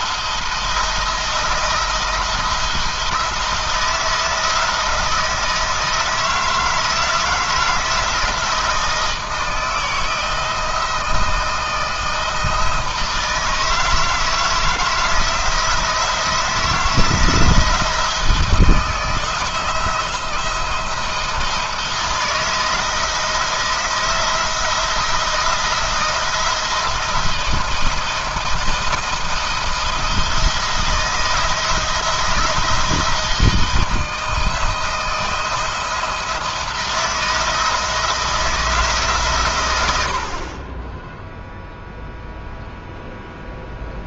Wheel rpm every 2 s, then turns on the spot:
170, 170, 160, 160, 160, 160, 160, 160, 160, 160, 170, 170, 160, 170, 170, 170, 170, 170, 170, 160, 40, 0.
none